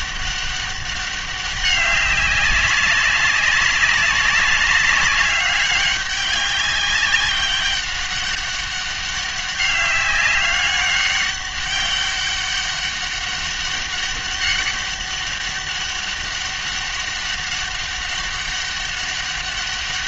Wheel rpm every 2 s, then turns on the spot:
200, 200, 190, 200, 200, 200, 200, 200, 200, 190.
none